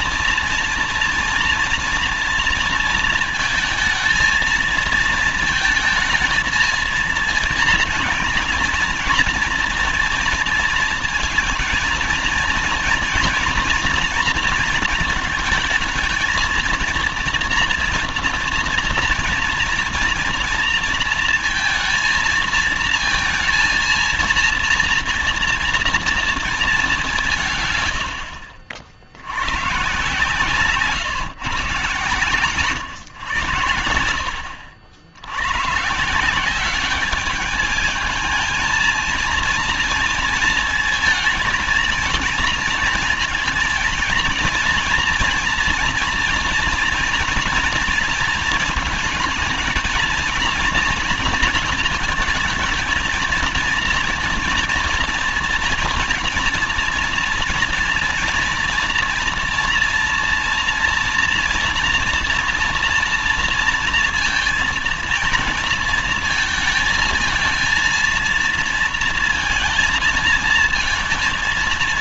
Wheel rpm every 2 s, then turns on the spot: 230, 230, 230, 230, 240, 230, 230, 220, 230, 230, 230, 230, 230, 180, 70, 140, 120, 80, 210, 230, 220, 230, 230, 230, 230, 230, 220, 240, 230, 230, 230, 230, 230, 230, 230, 220.
none